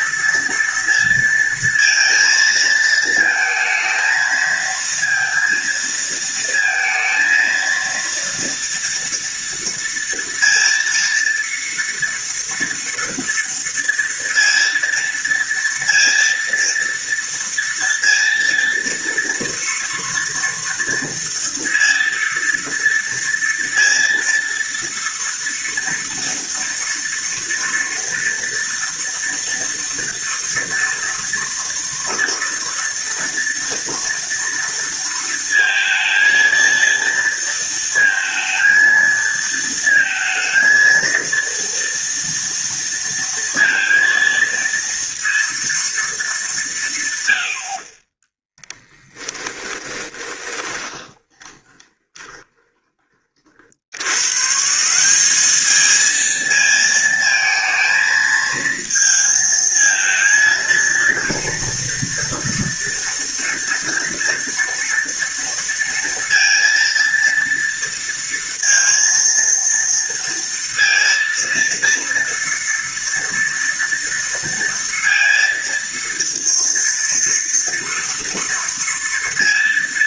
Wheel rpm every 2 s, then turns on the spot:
230, 220, 230, 220, 230, 230, 230, 230, 230, 230, 230, 230, 230, 230, 230, 230, 230, 230, 230, 220, 230, 230, 230, 150, 10, 30, 20, 170, 220, 220, 230, 230, 230, 230, 230, 230, 230, 230, 230, 230.
48-52